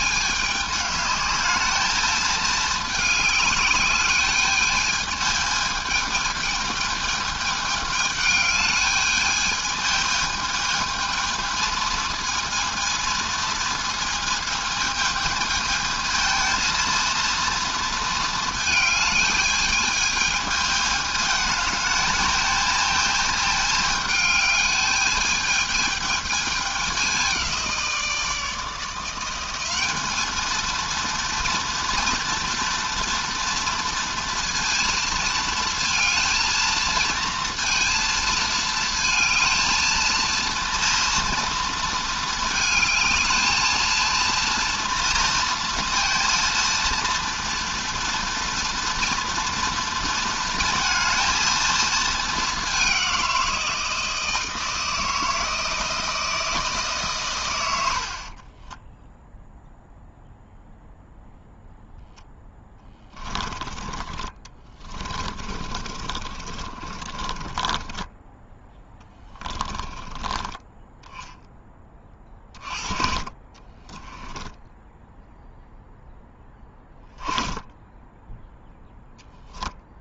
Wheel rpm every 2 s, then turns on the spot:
210, 210, 210, 220, 210, 220, 230, 220, 230, 220, 220, 220, 210, 200, 170, 230, 230, 230, 230, 220, 230, 220, 230, 230, 230, 230, 190, 160, 140, 10, 0, 10, 20, 30, 10, 10, 40, 0, 10, 0.
62-70 72-74